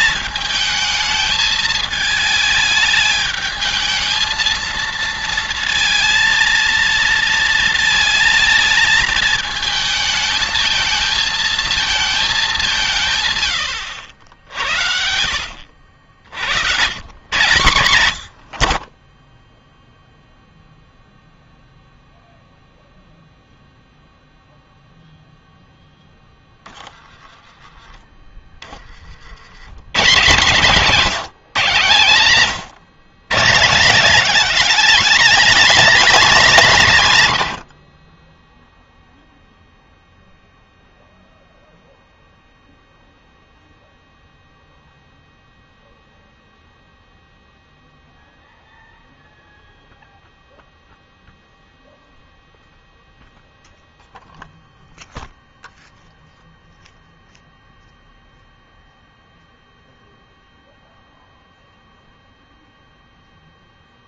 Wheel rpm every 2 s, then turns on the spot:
220, 210, 230, 230, 220, 220, 170, 60, 80, 30, 0, 0, 0, 10, 40, 160, 150, 260, 160, 0, 0, 0, 0, 0, 0, 0, 0, 0, 0, 0, 0, 0.
none